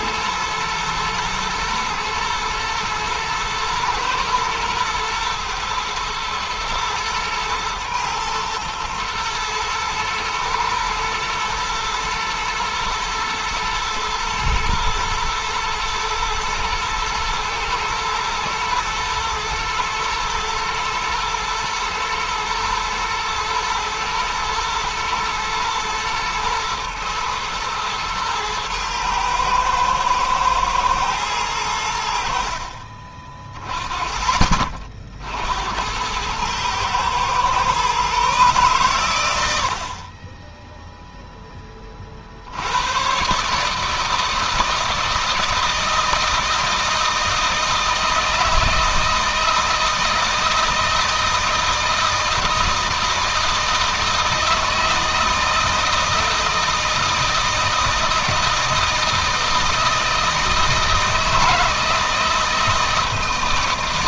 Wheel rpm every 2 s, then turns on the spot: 120, 110, 120, 110, 110, 110, 120, 110, 110, 120, 120, 110, 110, 120, 110, 110, 40, 50, 110, 120, 0, 120, 160, 160, 160, 160, 160, 160, 160, 160, 170, 160.
none